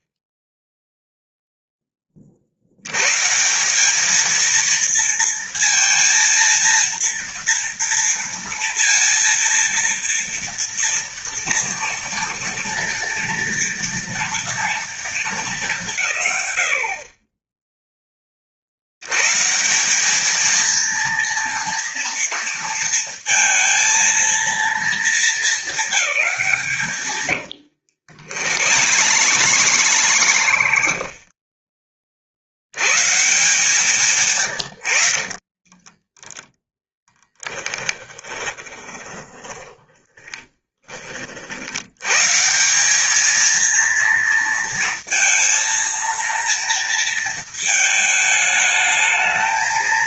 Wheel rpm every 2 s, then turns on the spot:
0, 70, 230, 230, 230, 230, 230, 230, 120, 70, 230, 230, 220, 160, 90, 80, 110, 110, 10, 20, 20, 170, 230, 230, 220.
28-32 38-42